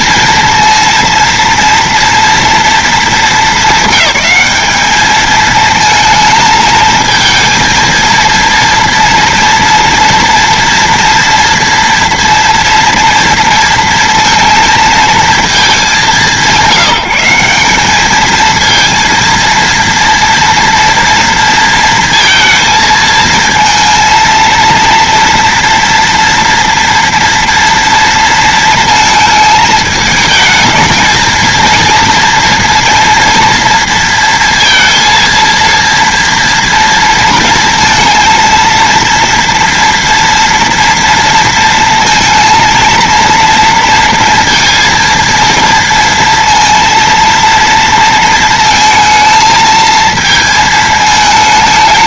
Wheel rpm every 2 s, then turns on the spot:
230, 230, 210, 220, 230, 240, 230, 230, 180, 230, 230, 230, 230, 230, 220, 220, 230, 230, 230, 230, 230, 230, 230, 230, 230, 220.
none